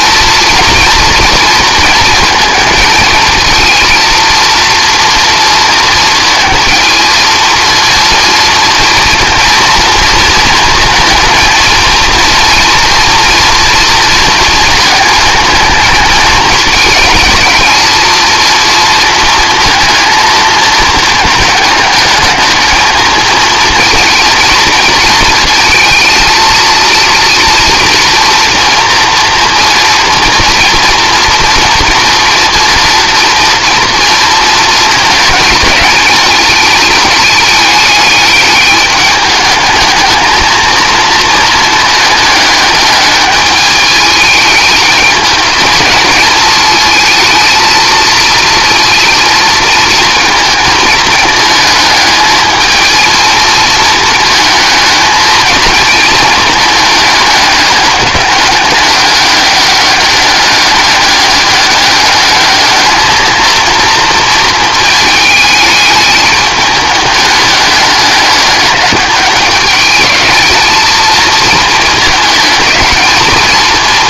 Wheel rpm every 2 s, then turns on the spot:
230, 220, 230, 220, 230, 230, 230, 230, 220, 230, 220, 220, 230, 230, 240, 240, 230, 230, 220, 210, 220, 210, 210, 220, 230, 220, 220, 220, 220, 200, 200, 210, 220, 210, 210, 220, 210.
none